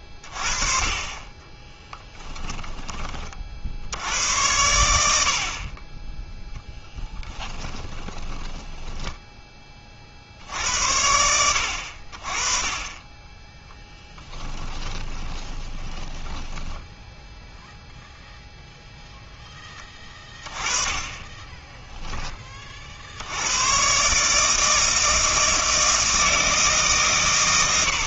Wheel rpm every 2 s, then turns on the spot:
30, 20, 90, 10, 10, 80, 30, 10, 10, 0, 20, 30, 160, 150.
6-10 14-16